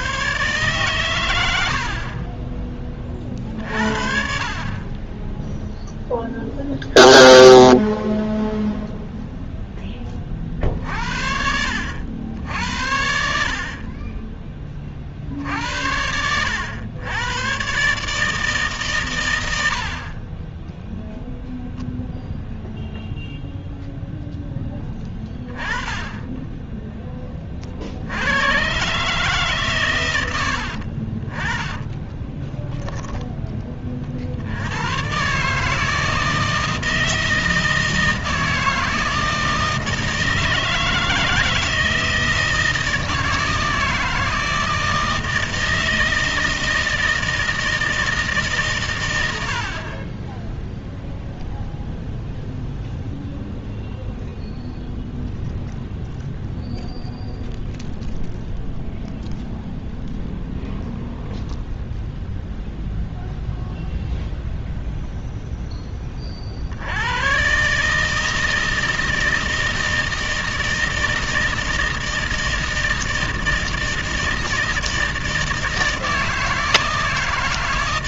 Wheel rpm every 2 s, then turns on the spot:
110, 20, 50, 0, 0, 40, 70, 20, 90, 150, 10, 0, 10, 20, 110, 80, 10, 90, 160, 160, 160, 160, 160, 160, 150, 10, 0, 0, 0, 0, 0, 0, 0, 60, 160, 160, 160, 160, 160.
20-22 32-34